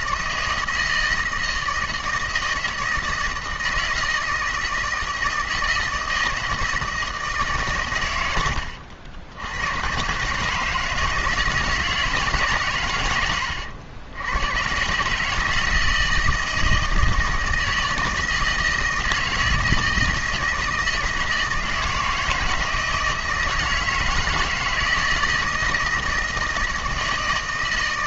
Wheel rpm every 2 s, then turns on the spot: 160, 160, 160, 160, 90, 140, 140, 100, 160, 160, 160, 160, 160, 170.
none